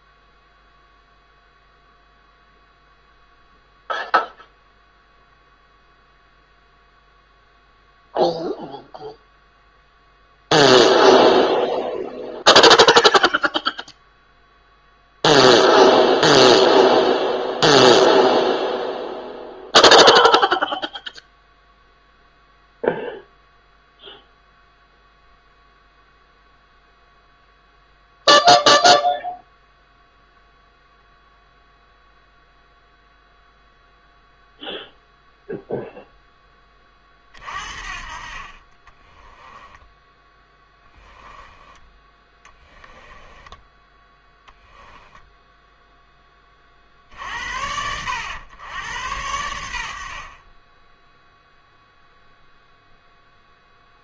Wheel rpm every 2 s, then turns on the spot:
0, 0, 0, 0, 0, 0, 0, 0, 0, 0, 0, 0, 0, 0, 0, 0, 0, 0, 20, 30, 10, 10, 10, 40, 100, 20, 0.
40-44